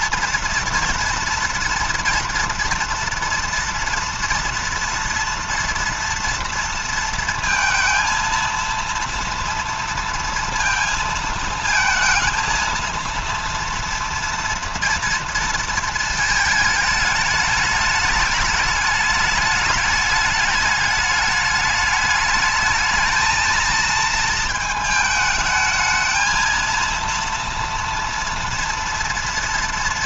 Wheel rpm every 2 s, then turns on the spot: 230, 230, 230, 230, 230, 230, 230, 230, 220, 210, 210, 220, 220, 230, 230.
none